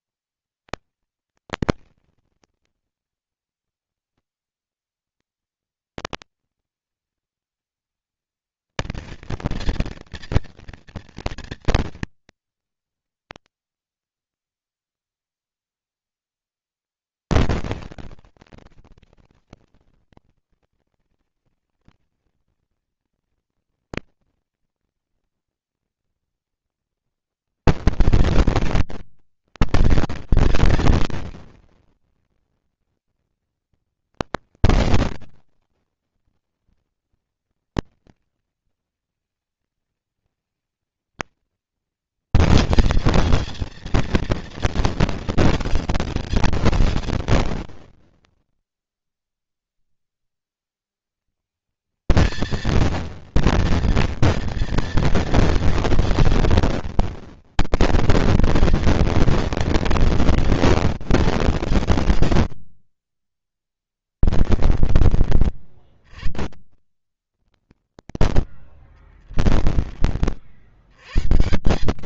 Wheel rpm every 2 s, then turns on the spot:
230, 230, 230, 230, 230, 230, 230, 230, 230, 230, 230, 230, 230, 240, 230, 230, 240, 220, 230, 230, 230, 220, 230, 200, 30, 110, 230, 230, 240, 230, 220, 40, 40, 50, 20, 100.
62-64 66-70